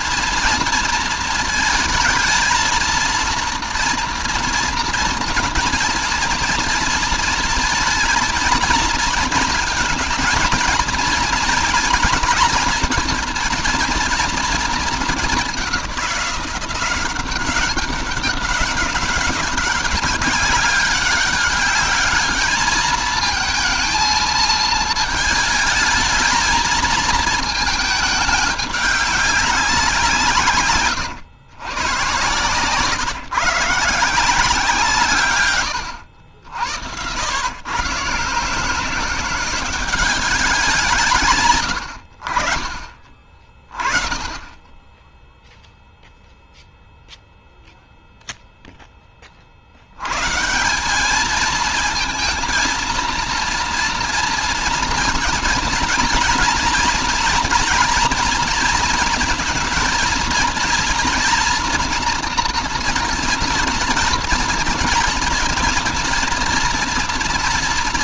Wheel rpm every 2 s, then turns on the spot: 240, 230, 230, 230, 220, 220, 220, 230, 180, 190, 200, 210, 220, 220, 210, 130, 130, 170, 90, 160, 180, 50, 20, 0, 10, 170, 230, 230, 230, 230, 230, 230, 230, 230.
none